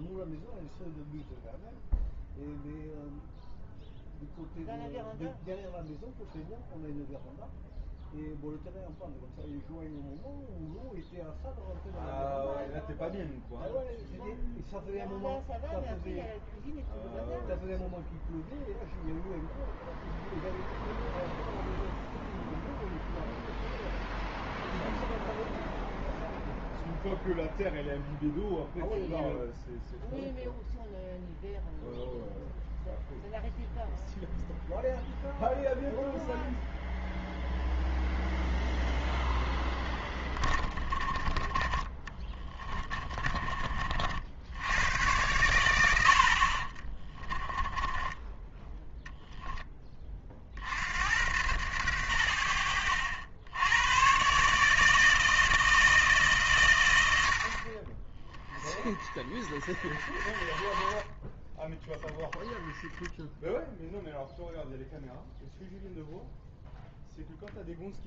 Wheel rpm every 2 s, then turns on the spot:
0, 0, 0, 0, 0, 0, 0, 0, 0, 0, 0, 0, 0, 0, 0, 0, 0, 0, 0, 0, 20, 20, 90, 30, 10, 80, 80, 160, 100, 30, 30, 10, 0, 0.
42-44 46-48